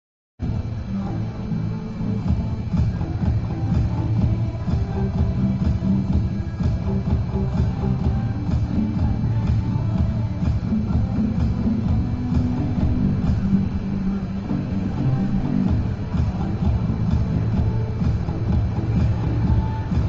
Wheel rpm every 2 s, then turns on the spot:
0, 0, 0, 0, 0, 0, 0, 0, 0, 0.
none